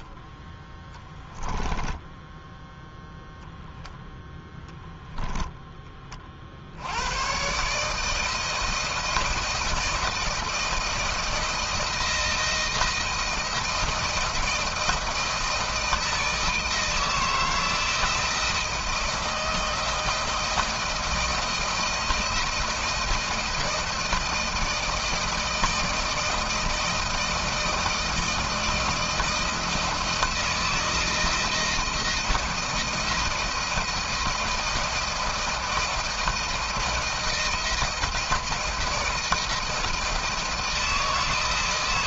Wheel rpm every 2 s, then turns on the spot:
10, 0, 10, 70, 160, 170, 170, 160, 160, 170, 160, 160, 160, 160, 160, 160, 170, 160, 160, 160, 160.
none